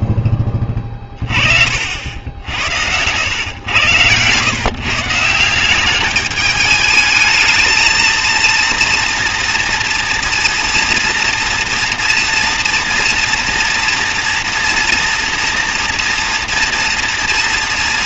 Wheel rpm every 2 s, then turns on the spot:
20, 80, 140, 210, 230, 230, 230, 230, 230.
none